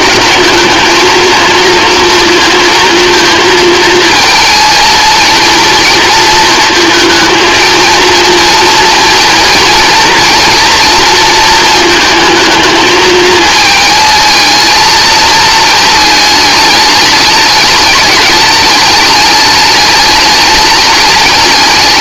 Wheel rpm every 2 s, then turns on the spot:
220, 230, 230, 230, 230, 230, 220, 220, 210, 210, 210.
none